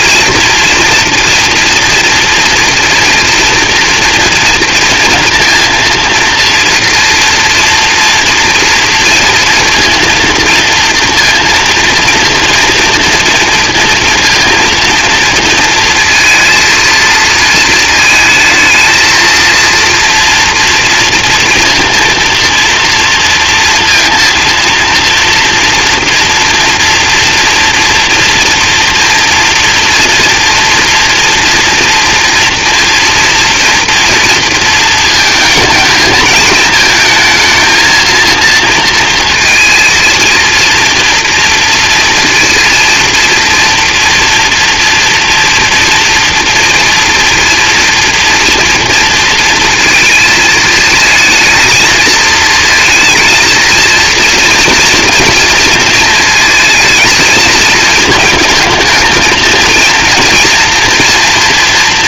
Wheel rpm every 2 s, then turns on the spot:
230, 230, 230, 230, 230, 230, 230, 230, 230, 220, 230, 230, 230, 240, 230, 230, 240, 230, 220, 230, 230, 230, 230, 240, 240, 220, 230, 230, 220, 220, 230.
none